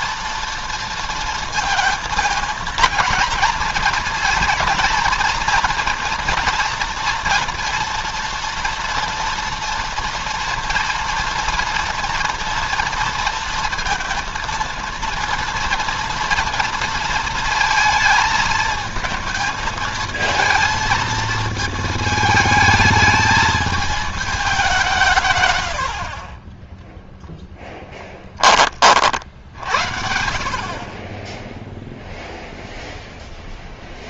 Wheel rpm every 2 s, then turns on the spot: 230, 220, 230, 230, 240, 230, 230, 230, 230, 220, 220, 220, 190, 10, 30, 60, 0.
26-28